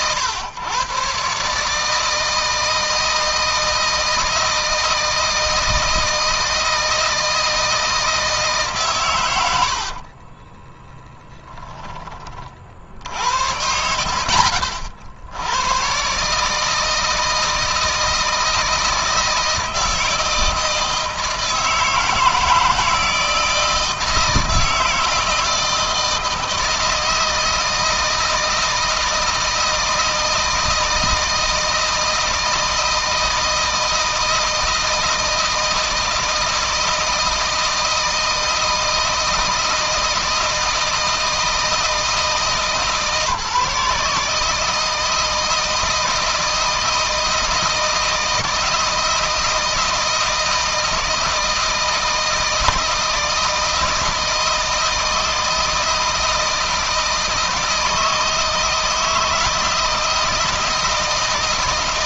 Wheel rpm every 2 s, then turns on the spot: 120, 160, 160, 160, 120, 10, 70, 70, 160, 160, 160, 160, 160, 160, 160, 160, 160, 160, 160, 160, 160, 160, 160, 160, 160, 160, 160, 160, 160, 160, 160.
10-12